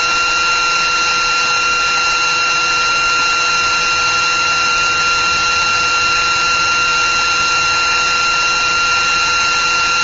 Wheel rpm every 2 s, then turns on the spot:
360, 360, 360, 360, 360.
none